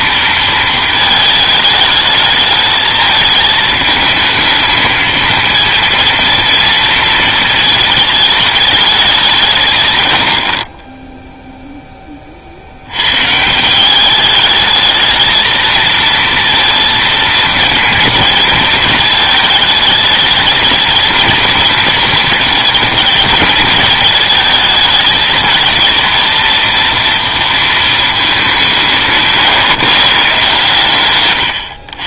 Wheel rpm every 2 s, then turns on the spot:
230, 210, 220, 230, 210, 40, 60, 220, 230, 230, 220, 220, 220, 230, 180, 140.
none